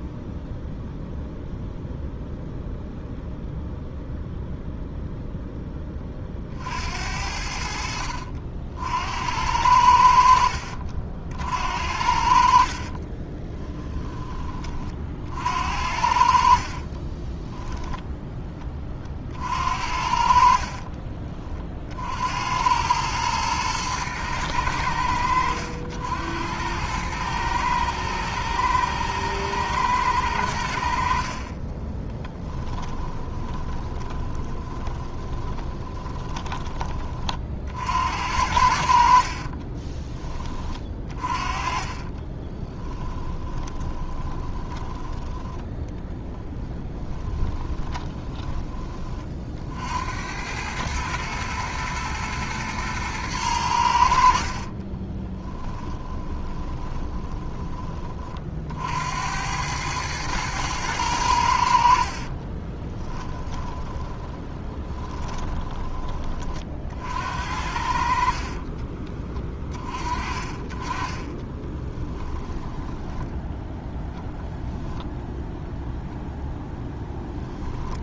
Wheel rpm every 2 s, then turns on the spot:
0, 0, 0, 60, 70, 50, 40, 40, 30, 30, 50, 100, 90, 100, 120, 70, 10, 20, 20, 60, 30, 30, 10, 10, 20, 110, 110, 30, 20, 60, 110, 20, 30, 50, 30, 30, 10, 0, 10.
12-14 16-18 20-22 32-36 40-48 54-58 62-66 68-70 72-74